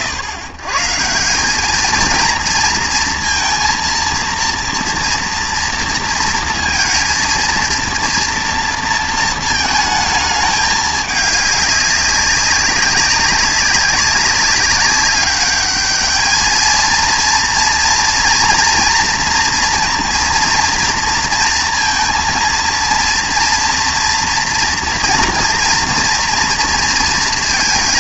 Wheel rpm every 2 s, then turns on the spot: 120, 230, 230, 230, 230, 210, 190, 200, 220, 240, 230, 230, 230, 230.
none